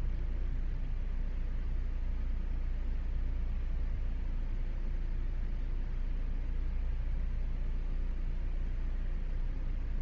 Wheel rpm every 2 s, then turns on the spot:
0, 0, 0, 0, 0.
none